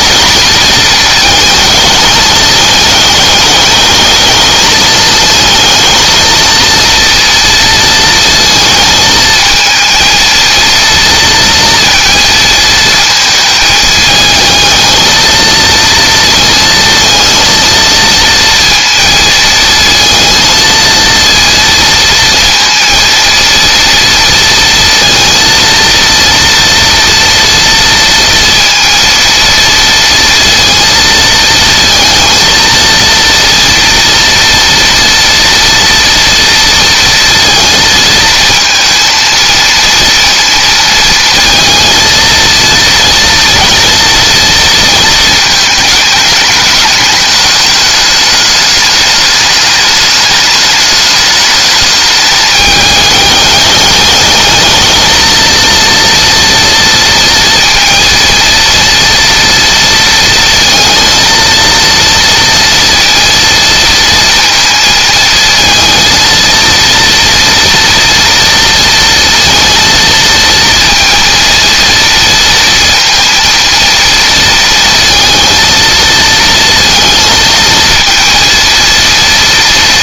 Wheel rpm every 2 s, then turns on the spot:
220, 210, 220, 230, 230, 230, 230, 220, 230, 230, 230, 230, 230, 230, 230, 230, 230, 230, 230, 230, 230, 230, 230, 210, 210, 210, 210, 220, 230, 230, 230, 230, 230, 230, 230, 230, 230, 230, 230, 230.
none